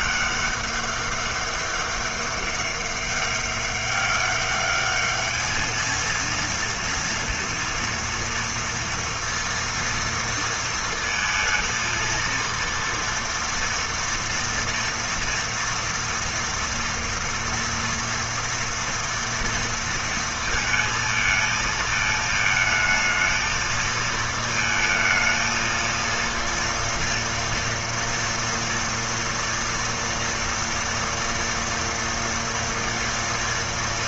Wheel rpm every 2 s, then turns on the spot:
200, 200, 200, 230, 230, 230, 230, 230, 230, 230, 230, 220, 230, 230, 240, 230, 230.
none